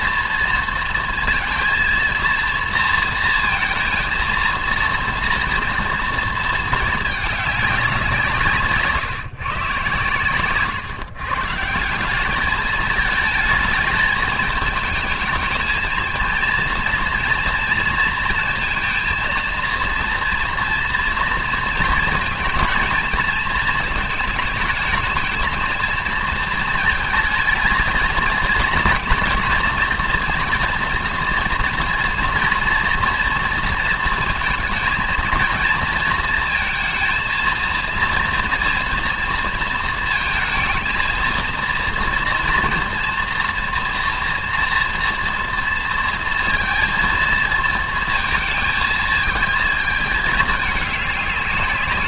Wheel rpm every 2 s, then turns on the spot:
230, 230, 230, 220, 150, 130, 210, 220, 230, 230, 240, 230, 220, 230, 230, 240, 230, 230, 230, 230, 230, 230, 230, 230, 220, 210.
none